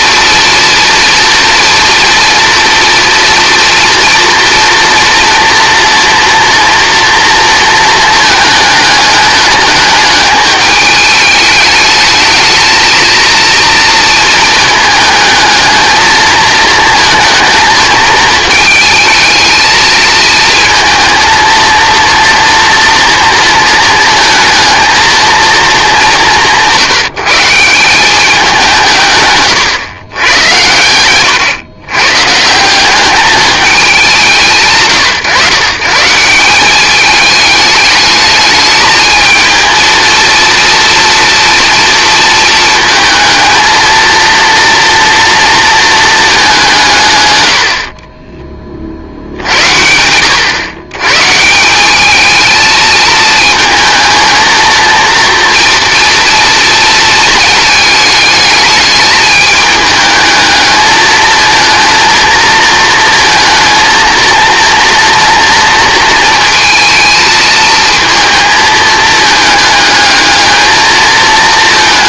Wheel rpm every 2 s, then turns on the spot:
240, 230, 230, 230, 220, 210, 220, 220, 220, 220, 230, 230, 220, 180, 180, 110, 190, 140, 200, 210, 230, 220, 230, 180, 30, 120, 220, 230, 230, 210, 220, 230, 230, 230, 220, 220.
none